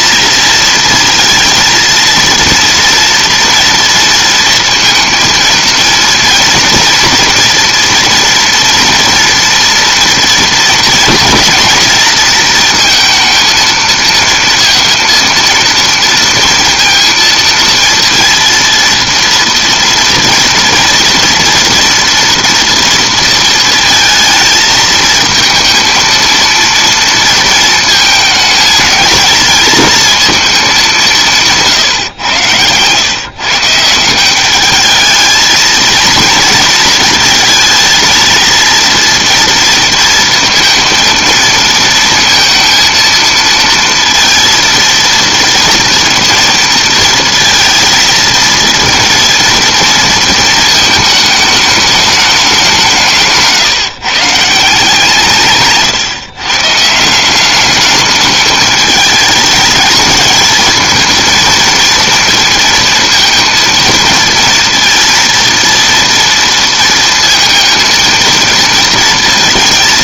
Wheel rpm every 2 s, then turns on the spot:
230, 230, 230, 240, 230, 230, 230, 230, 230, 230, 230, 230, 220, 230, 220, 210, 120, 200, 230, 230, 230, 230, 230, 230, 230, 220, 190, 160, 140, 210, 220, 230, 230, 230, 230.
none